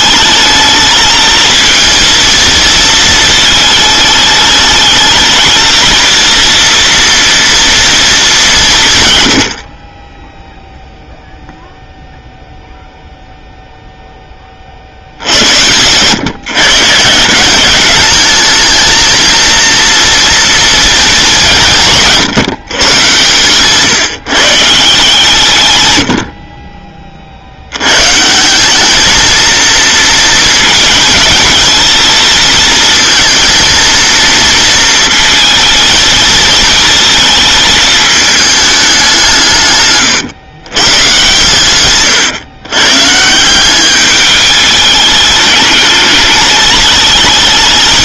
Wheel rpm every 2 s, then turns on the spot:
220, 220, 220, 230, 180, 0, 0, 40, 140, 220, 230, 140, 160, 50, 190, 220, 230, 230, 220, 210, 120, 120, 210, 210.
none